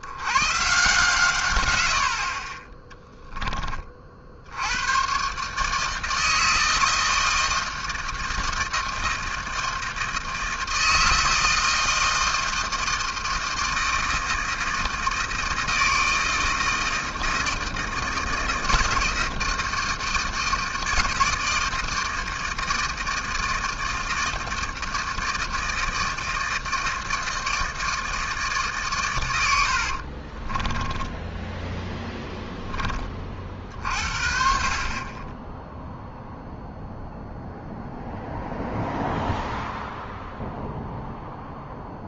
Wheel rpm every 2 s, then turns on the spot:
130, 30, 90, 160, 160, 160, 160, 160, 160, 160, 160, 160, 160, 160, 150, 20, 10, 40, 0, 0, 0.
30-32